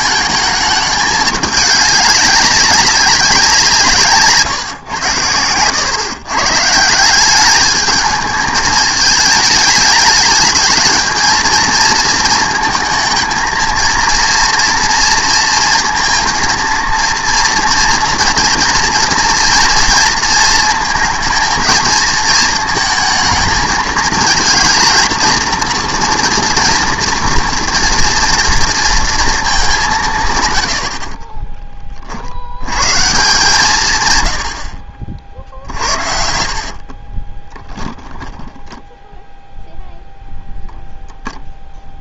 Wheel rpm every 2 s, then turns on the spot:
210, 200, 140, 150, 210, 220, 220, 230, 230, 230, 220, 220, 220, 240, 230, 100, 110, 70, 60, 0, 0.
36-38